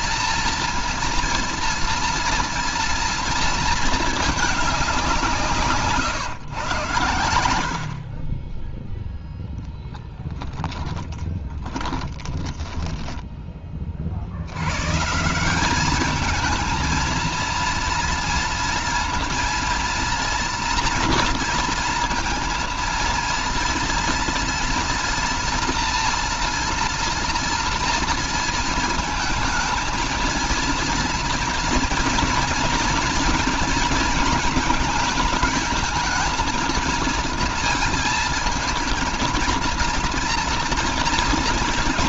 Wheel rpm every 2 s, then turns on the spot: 230, 230, 190, 110, 0, 10, 10, 120, 220, 230, 230, 230, 230, 230, 220, 230, 240, 220, 220, 230, 230.
10-14